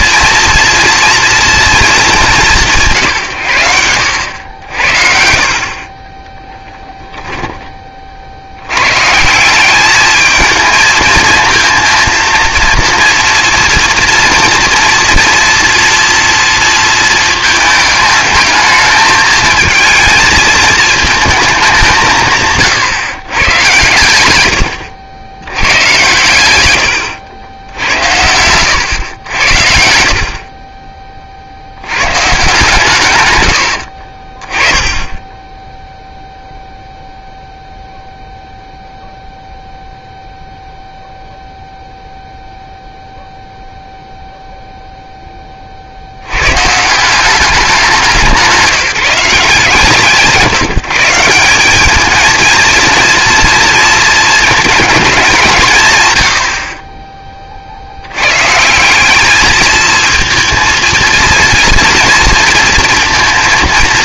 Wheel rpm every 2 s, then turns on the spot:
230, 190, 80, 10, 90, 220, 230, 230, 230, 220, 220, 150, 100, 110, 100, 40, 140, 20, 0, 0, 0, 0, 0, 120, 180, 150, 230, 220, 60, 160, 220, 230.
6-8